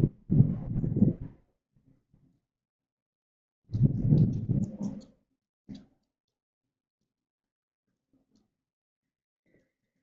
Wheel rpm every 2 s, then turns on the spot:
0, 0, 0, 0, 0.
none